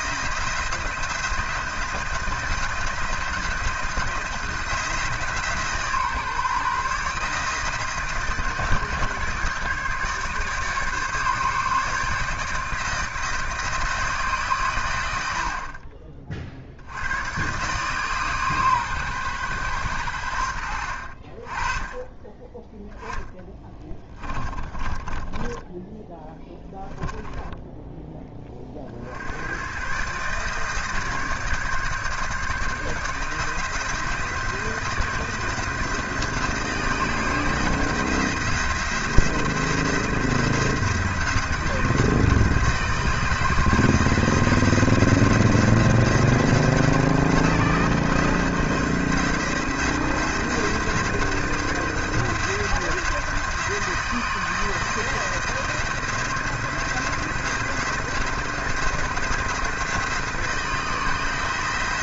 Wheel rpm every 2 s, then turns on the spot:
170, 170, 170, 150, 150, 140, 160, 120, 70, 140, 70, 10, 30, 10, 50, 150, 150, 160, 160, 170, 170, 160, 170, 170, 170, 170, 170, 160, 170, 170, 160.
24-28